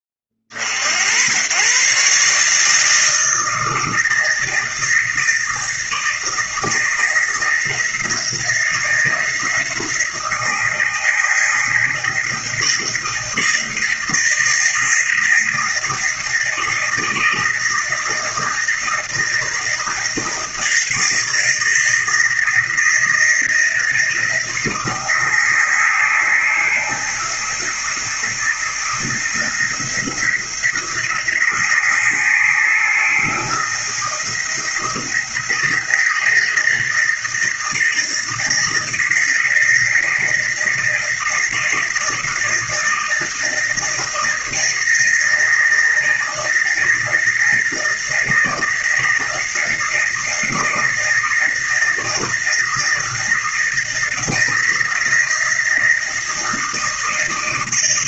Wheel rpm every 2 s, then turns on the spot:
30, 150, 160, 160, 160, 160, 160, 160, 160, 160, 160, 160, 170, 160, 160, 170, 160, 160, 160, 160, 160, 160, 160, 160, 160, 160, 170, 160, 160.
none